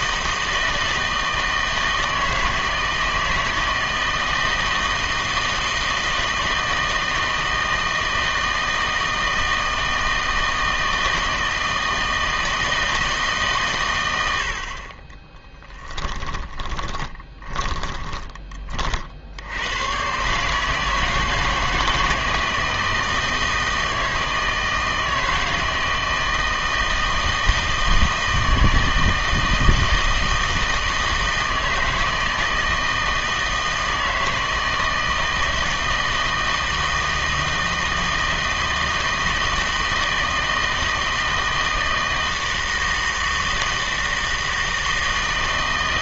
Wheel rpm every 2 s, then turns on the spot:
160, 160, 160, 160, 160, 160, 160, 60, 20, 20, 150, 160, 160, 160, 160, 160, 160, 160, 160, 160, 160, 160, 160.
16-18